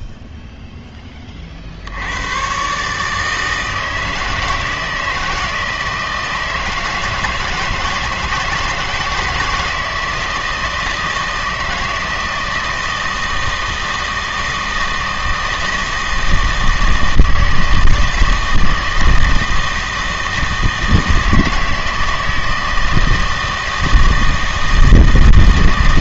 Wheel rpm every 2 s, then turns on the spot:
0, 130, 160, 160, 160, 160, 160, 160, 160, 160, 160, 160, 160.
none